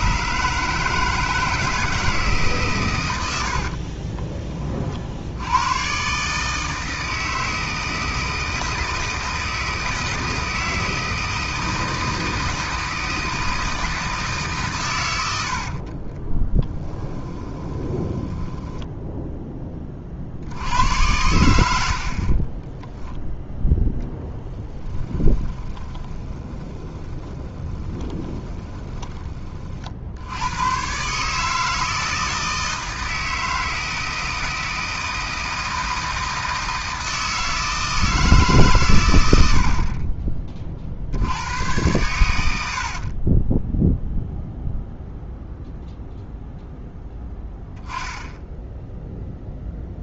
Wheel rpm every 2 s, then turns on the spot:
160, 130, 30, 160, 160, 160, 160, 130, 10, 10, 90, 20, 20, 30, 20, 110, 160, 160, 160, 140, 50, 70, 0, 0, 0.
16-20 22-30